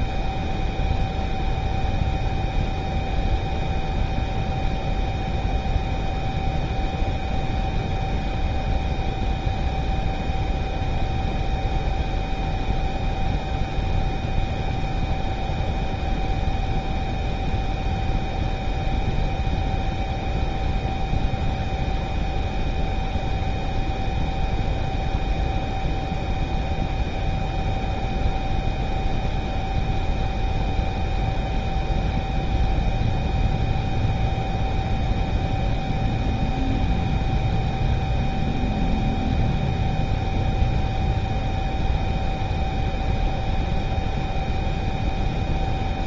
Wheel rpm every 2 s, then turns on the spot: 0, 0, 0, 0, 0, 0, 0, 0, 0, 0, 0, 0, 0, 0, 0, 0, 0, 0, 0, 0, 0, 0, 0.
none